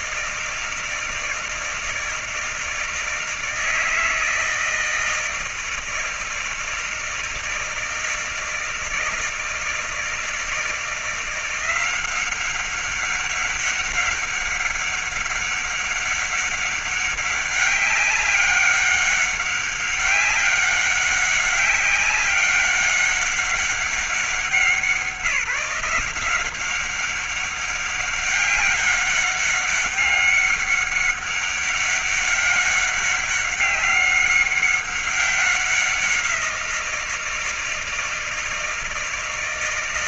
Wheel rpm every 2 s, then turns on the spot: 160, 160, 160, 160, 160, 160, 190, 200, 200, 200, 200, 190, 190, 190, 200, 200, 200, 190, 170, 160.
none